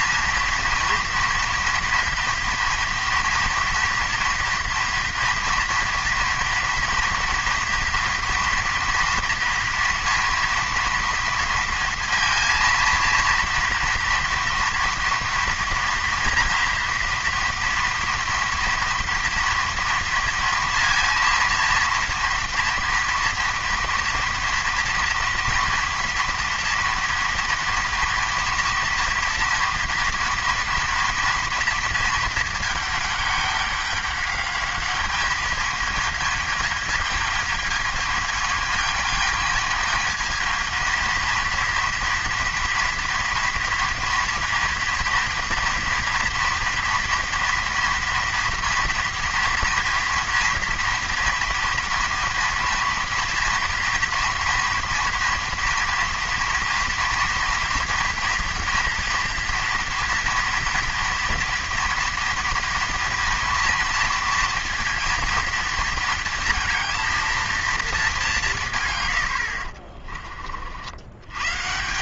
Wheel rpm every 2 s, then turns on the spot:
230, 230, 240, 230, 230, 230, 230, 230, 230, 230, 230, 230, 230, 230, 230, 230, 210, 210, 220, 220, 230, 230, 230, 230, 230, 230, 230, 230, 230, 230, 230, 230, 230, 230, 90, 110.
none